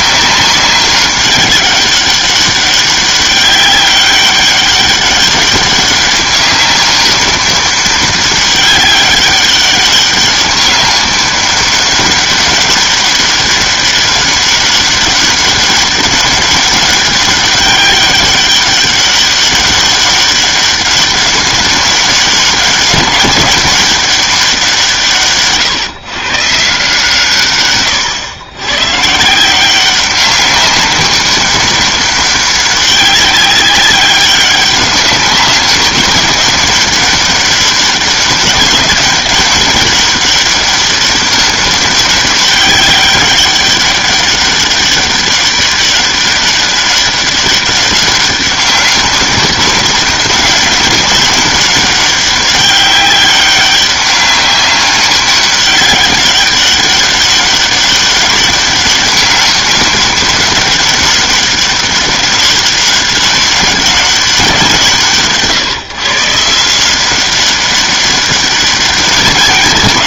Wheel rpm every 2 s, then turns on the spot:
190, 200, 200, 200, 200, 200, 200, 200, 200, 190, 200, 200, 160, 160, 130, 190, 200, 200, 200, 200, 200, 200, 200, 200, 200, 200, 200, 200, 200, 200, 200, 200, 170, 170, 200.
none